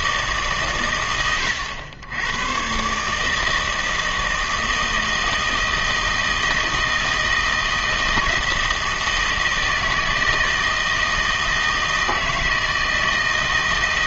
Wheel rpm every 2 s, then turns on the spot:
140, 120, 160, 160, 160, 160, 160.
none